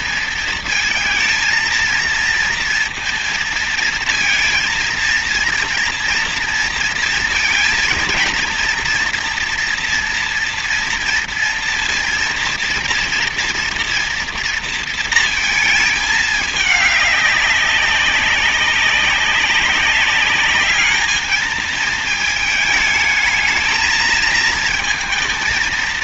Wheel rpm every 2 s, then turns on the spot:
220, 230, 230, 230, 240, 230, 230, 230, 210, 190, 210, 220, 220.
none